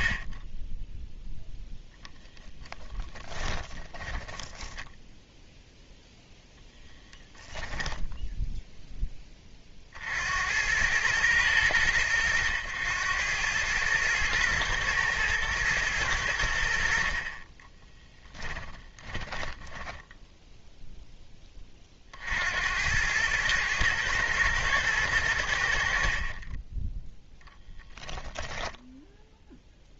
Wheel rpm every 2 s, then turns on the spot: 0, 10, 0, 0, 20, 110, 110, 120, 30, 10, 0, 100, 100, 10, 10.
2-4 18-20